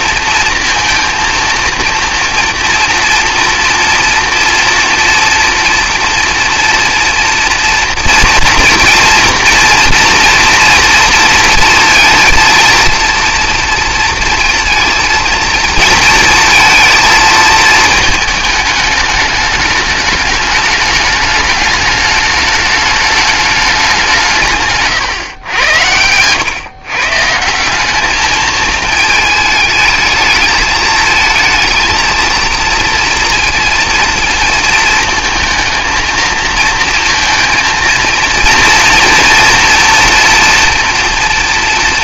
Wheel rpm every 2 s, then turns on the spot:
230, 230, 230, 230, 240, 240, 230, 230, 230, 210, 210, 210, 140, 130, 220, 220, 230, 220, 230, 230, 230.
none